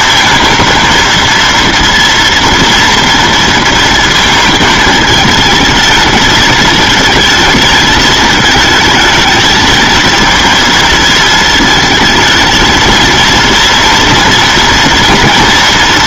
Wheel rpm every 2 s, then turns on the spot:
220, 230, 220, 220, 220, 220, 220, 230.
none